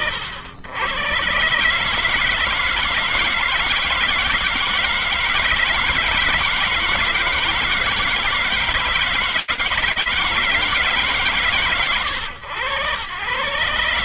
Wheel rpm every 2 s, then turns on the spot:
80, 160, 160, 160, 160, 150, 110.
none